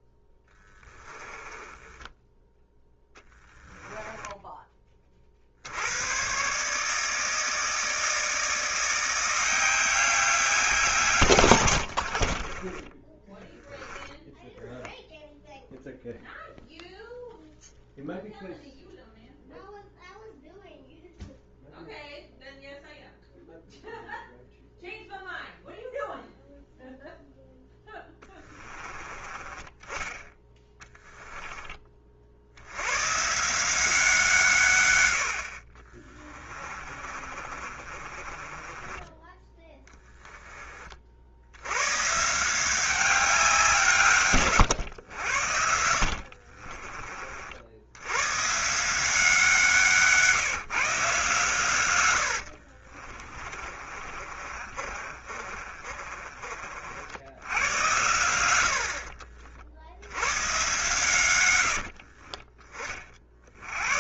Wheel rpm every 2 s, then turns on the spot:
10, 10, 20, 140, 170, 180, 40, 0, 0, 0, 0, 0, 0, 0, 20, 10, 80, 140, 30, 30, 20, 170, 130, 40, 140, 160, 50, 40, 50, 80, 120, 30.
0-2 12-14 36-40 46-48 52-56